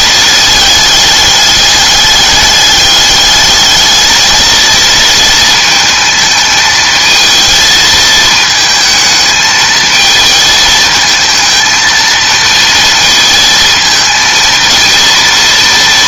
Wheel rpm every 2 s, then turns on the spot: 210, 210, 230, 220, 220, 220, 230, 230.
none